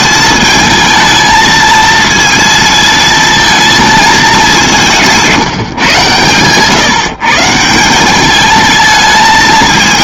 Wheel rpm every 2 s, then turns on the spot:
220, 220, 190, 150, 220.
none